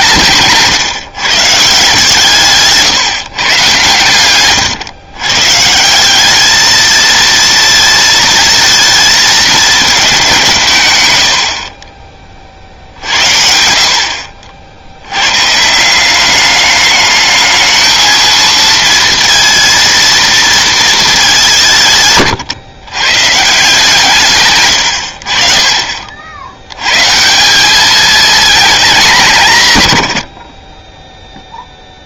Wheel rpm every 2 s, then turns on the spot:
140, 150, 120, 220, 230, 140, 70, 90, 210, 230, 220, 130, 90, 100, 210, 20.
none